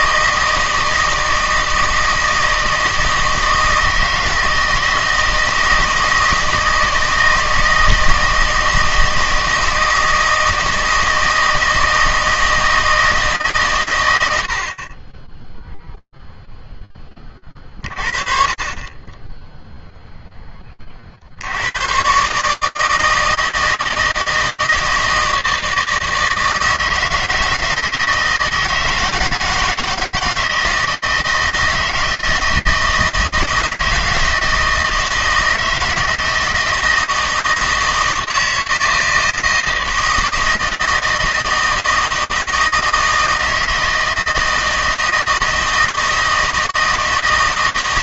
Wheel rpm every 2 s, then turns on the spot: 160, 160, 160, 160, 160, 160, 160, 70, 10, 30, 30, 160, 160, 160, 160, 160, 160, 160, 160, 160, 160, 160, 160, 160.
none